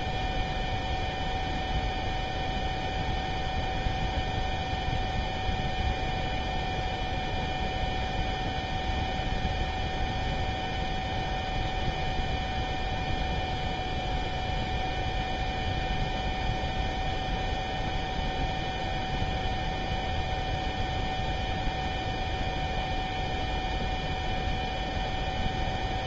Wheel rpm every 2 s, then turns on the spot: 0, 0, 0, 0, 0, 0, 0, 0, 0, 0, 0, 0, 0.
none